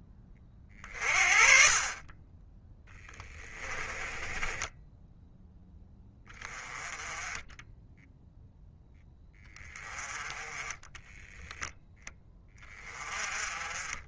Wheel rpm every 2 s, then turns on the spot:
40, 10, 10, 20, 20, 20, 30.
2-4 10-12